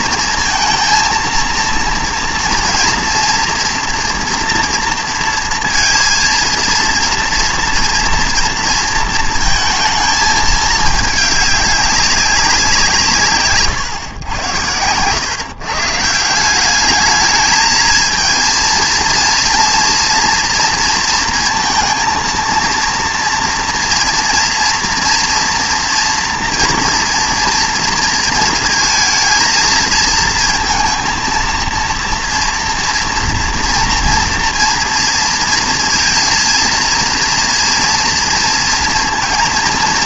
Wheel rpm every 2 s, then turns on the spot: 230, 230, 230, 230, 230, 220, 190, 100, 190, 220, 230, 230, 230, 230, 230, 230, 230, 230, 230, 230.
none